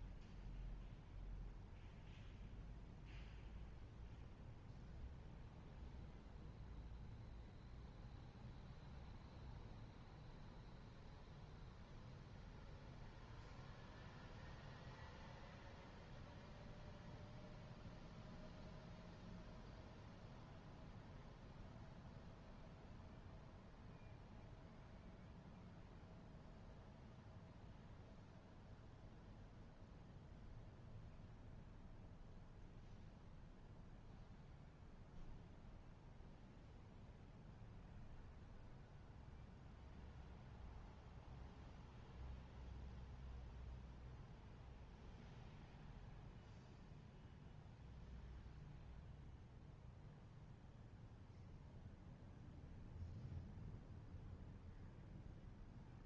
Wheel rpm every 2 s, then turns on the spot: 0, 0, 0, 0, 0, 0, 0, 0, 0, 0, 0, 0, 0, 0, 0, 0, 0, 0, 0, 0, 0, 0, 0, 0, 0, 0, 0, 0.
none